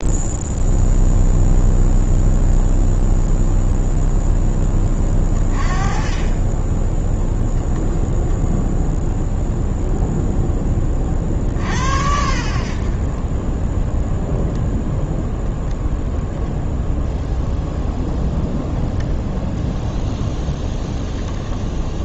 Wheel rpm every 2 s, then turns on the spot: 0, 0, 20, 20, 0, 10, 60, 0, 0, 0, 0.
none